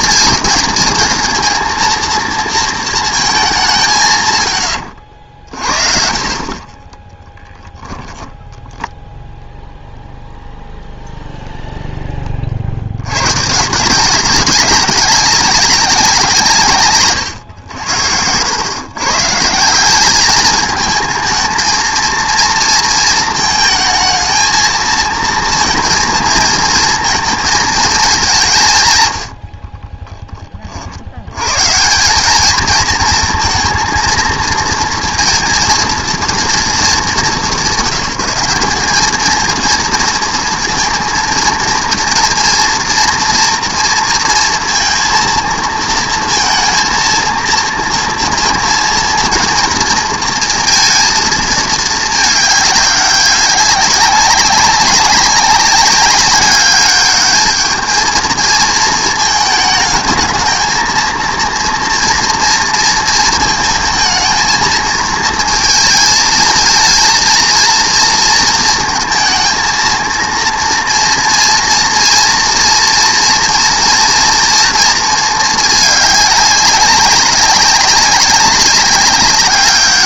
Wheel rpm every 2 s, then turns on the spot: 220, 230, 110, 30, 10, 0, 40, 200, 140, 110, 210, 230, 220, 230, 160, 30, 220, 230, 220, 190, 230, 230, 230, 230, 230, 230, 210, 190, 200, 220, 230, 230, 220, 220, 230, 230, 240, 230, 200, 200.
8-10